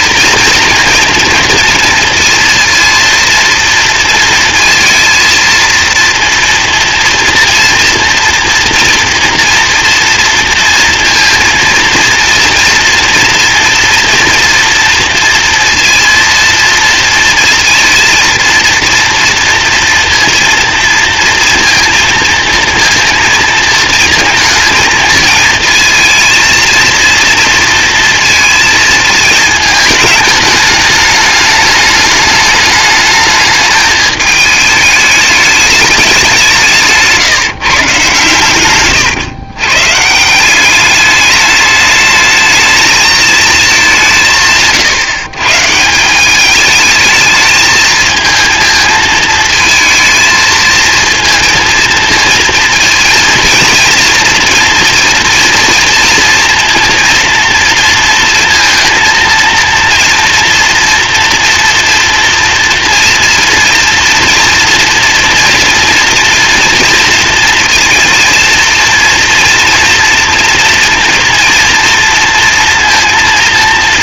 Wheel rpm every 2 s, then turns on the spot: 230, 230, 230, 240, 230, 230, 230, 230, 230, 230, 230, 230, 220, 230, 220, 210, 210, 210, 170, 110, 200, 210, 150, 210, 220, 220, 230, 230, 230, 230, 230, 230, 230, 230, 240, 230, 230.
none